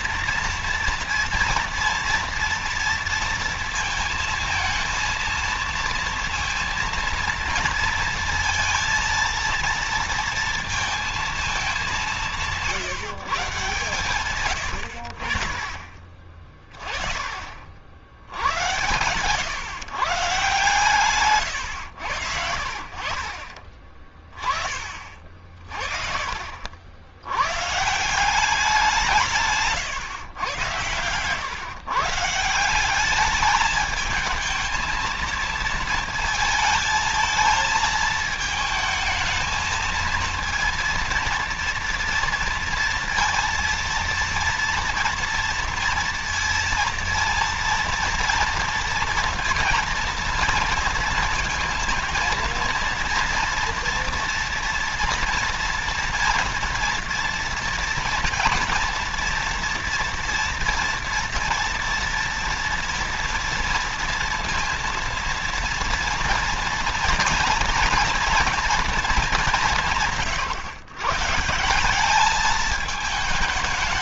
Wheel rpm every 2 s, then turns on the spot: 230, 230, 230, 230, 230, 230, 150, 90, 30, 110, 130, 40, 40, 70, 180, 100, 190, 220, 220, 220, 230, 230, 230, 230, 230, 230, 230, 240, 230, 230, 230, 230, 230, 240, 220, 120, 220.
none